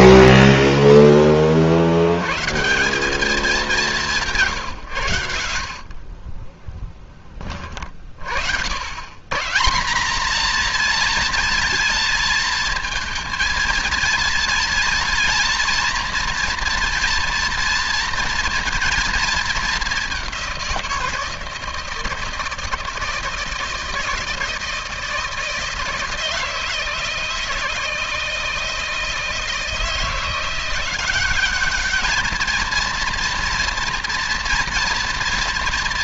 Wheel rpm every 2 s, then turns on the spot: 10, 170, 130, 30, 80, 230, 230, 230, 230, 230, 170, 160, 160, 160, 160, 180, 230, 230.
6-8